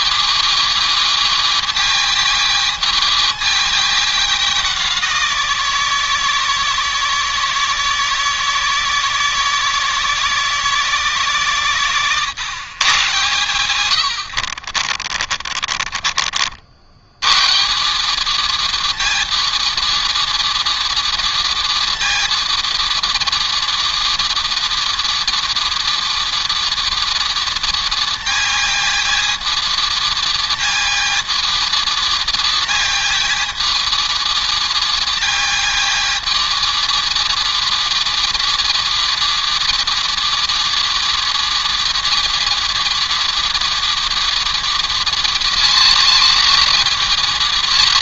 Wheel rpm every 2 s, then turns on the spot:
220, 220, 190, 160, 160, 160, 140, 50, 70, 220, 230, 230, 230, 230, 230, 230, 230, 230, 220, 230, 230, 230, 230, 220.
14-16